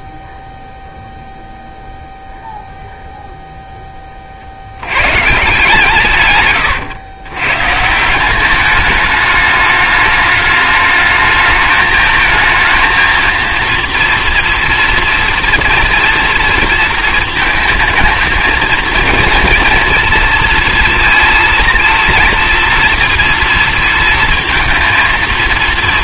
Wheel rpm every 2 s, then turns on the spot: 0, 0, 80, 120, 200, 210, 220, 230, 230, 220, 230, 230, 230.
none